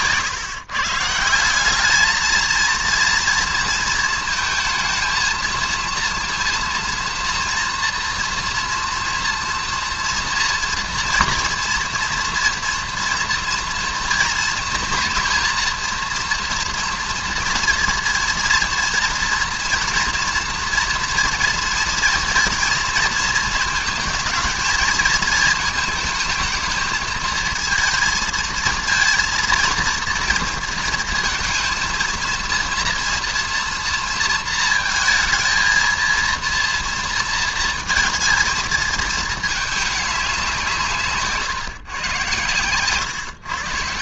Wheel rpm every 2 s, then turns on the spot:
140, 230, 220, 230, 230, 230, 230, 230, 230, 230, 230, 230, 220, 220, 230, 230, 230, 230, 230, 220, 180, 120.
none